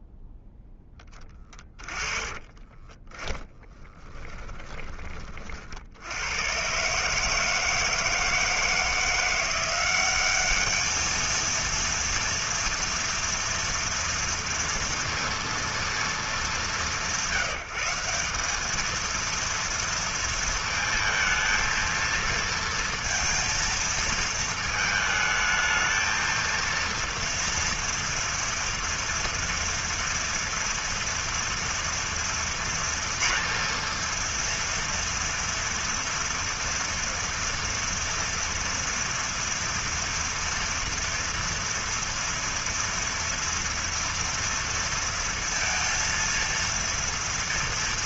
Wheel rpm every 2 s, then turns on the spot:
0, 20, 10, 100, 160, 200, 230, 230, 190, 200, 230, 230, 220, 220, 230, 230, 230, 230, 230, 230, 230, 230, 230, 230.
2-6